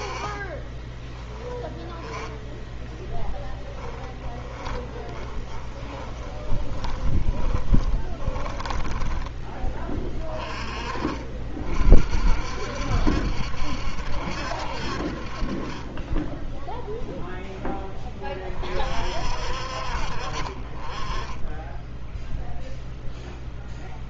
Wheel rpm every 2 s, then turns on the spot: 20, 10, 20, 20, 20, 30, 60, 60, 0, 40, 30, 0.
0-10